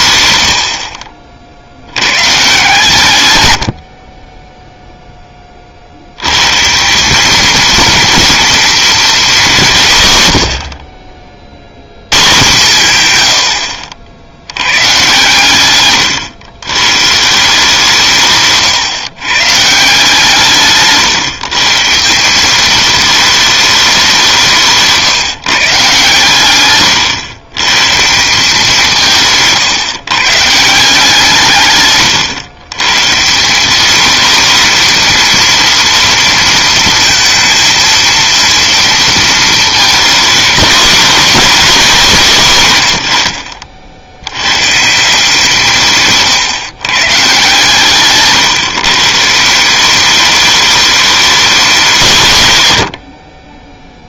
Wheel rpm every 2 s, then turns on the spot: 70, 150, 0, 160, 240, 70, 130, 120, 110, 130, 150, 210, 160, 120, 180, 160, 130, 230, 230, 230, 220, 140, 130, 140, 130, 210, 100.
none